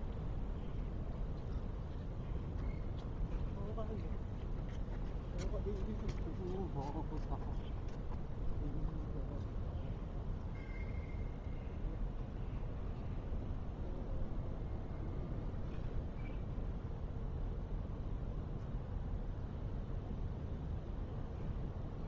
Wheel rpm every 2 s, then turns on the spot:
0, 0, 0, 0, 0, 0, 0, 0, 0, 0, 0.
none